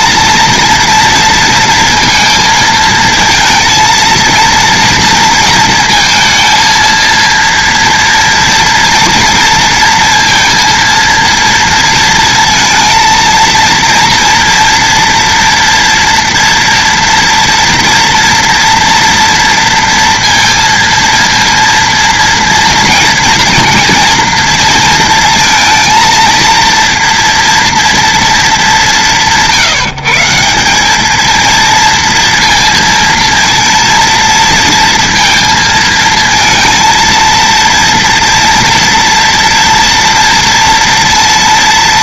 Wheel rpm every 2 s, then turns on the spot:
230, 220, 230, 230, 230, 230, 230, 230, 230, 230, 230, 230, 230, 230, 200, 190, 230, 230, 230, 230, 230.
none